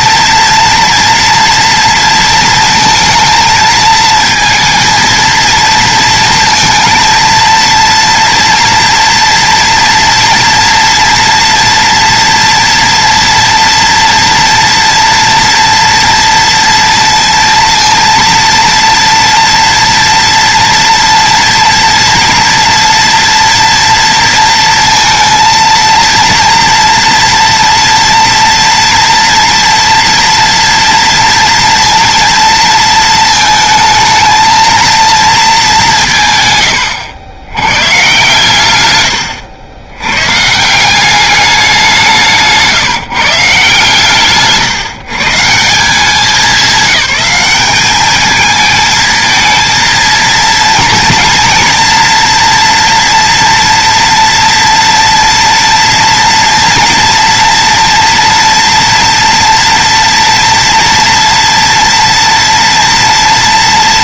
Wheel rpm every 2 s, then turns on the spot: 230, 230, 230, 230, 230, 230, 240, 230, 230, 230, 230, 230, 230, 230, 230, 230, 230, 220, 110, 120, 170, 160, 150, 210, 220, 230, 240, 230, 230, 230, 230, 230.
none